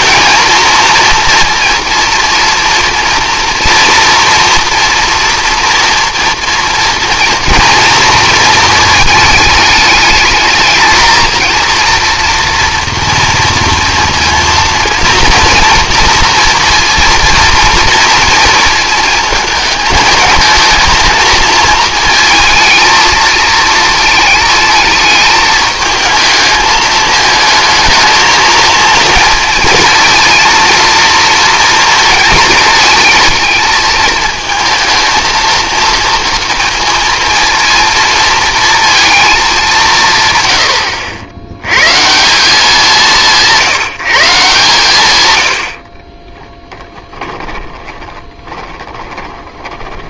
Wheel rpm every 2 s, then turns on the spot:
230, 230, 240, 230, 230, 220, 230, 230, 230, 230, 230, 220, 220, 220, 230, 230, 220, 220, 230, 230, 130, 190, 150, 20, 20.
46-50